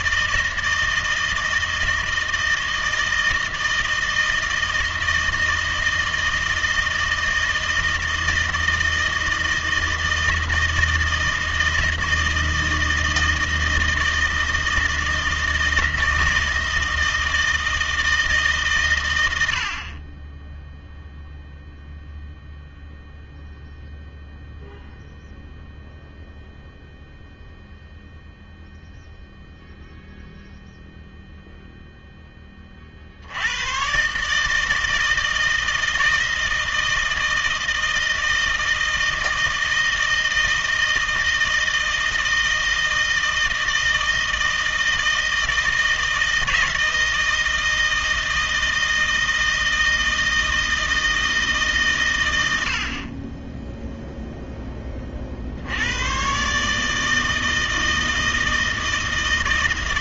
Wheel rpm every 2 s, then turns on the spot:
160, 160, 160, 160, 160, 160, 160, 160, 160, 130, 0, 0, 0, 0, 0, 0, 40, 160, 160, 160, 160, 160, 160, 160, 160, 160, 60, 10, 150, 160.
none